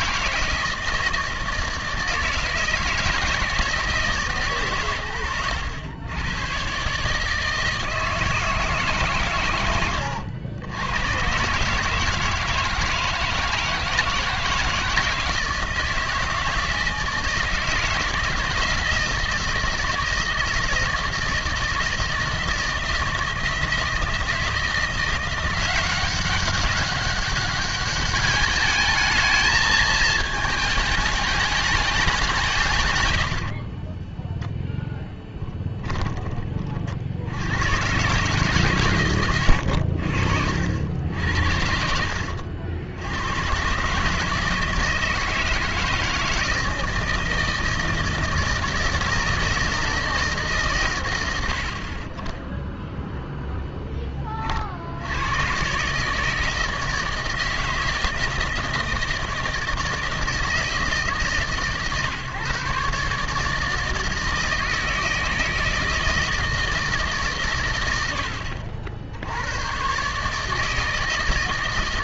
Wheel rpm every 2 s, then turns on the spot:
160, 160, 140, 120, 160, 100, 160, 160, 160, 170, 160, 160, 170, 200, 220, 220, 170, 0, 40, 140, 80, 80, 160, 160, 160, 130, 0, 60, 160, 160, 160, 140, 160, 160, 60, 160.
none